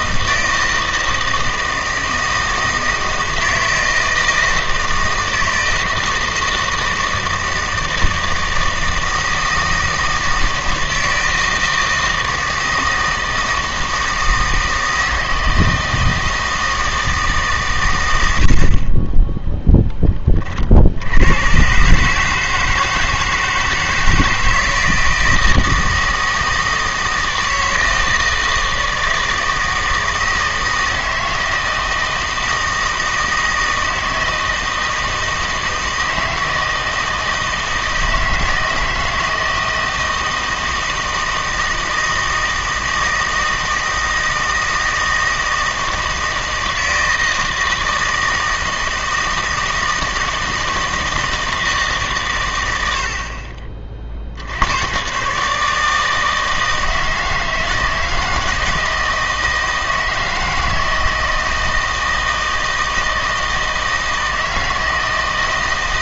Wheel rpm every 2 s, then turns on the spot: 160, 160, 160, 160, 160, 160, 160, 160, 160, 50, 60, 160, 160, 160, 160, 160, 160, 160, 160, 160, 160, 160, 160, 160, 160, 160, 90, 100, 160, 160, 160, 160, 160.
none